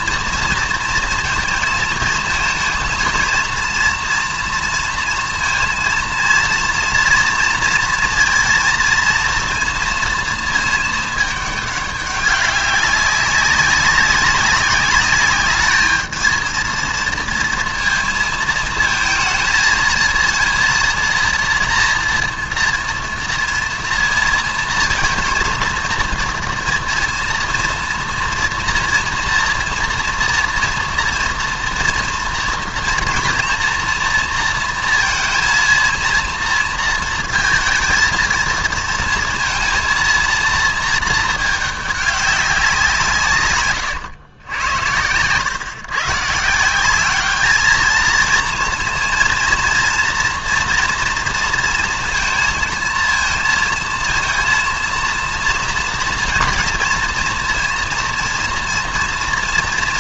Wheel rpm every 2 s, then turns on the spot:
230, 220, 230, 230, 230, 220, 190, 200, 230, 220, 230, 230, 230, 230, 230, 230, 240, 230, 230, 220, 230, 180, 100, 170, 230, 230, 230, 230, 230, 230.
none